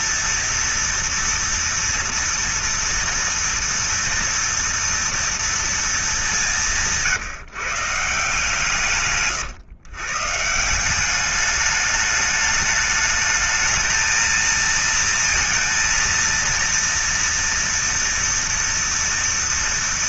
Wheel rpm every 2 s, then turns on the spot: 230, 230, 240, 220, 160, 140, 210, 220, 230, 230.
none